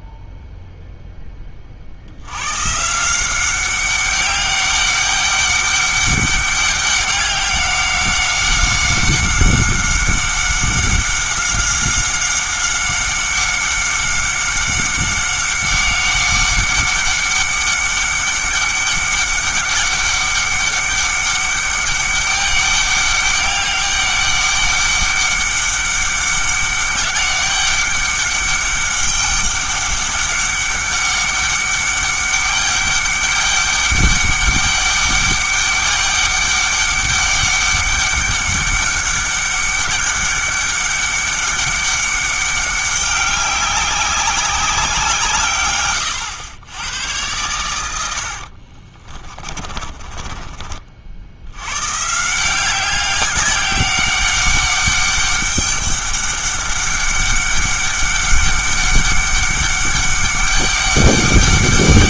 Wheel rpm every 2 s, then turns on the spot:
0, 140, 200, 200, 190, 190, 190, 190, 200, 200, 200, 200, 200, 200, 200, 190, 200, 200, 200, 200, 200, 200, 190, 100, 50, 40, 180, 200, 200, 200, 200.
48-50